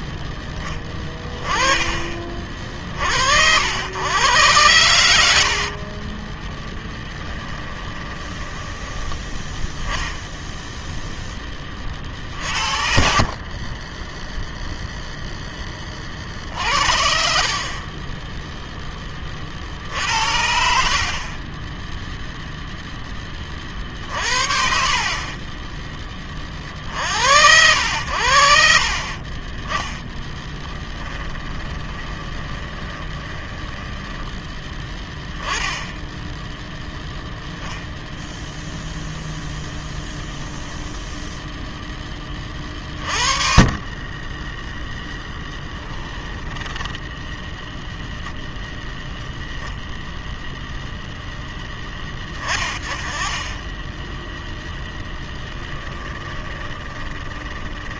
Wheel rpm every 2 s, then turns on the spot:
10, 50, 100, 20, 10, 0, 60, 0, 50, 10, 50, 0, 50, 50, 50, 10, 20, 10, 10, 0, 0, 30, 10, 10, 0, 0, 20, 10, 20.
6-10 30-34 46-48 56-58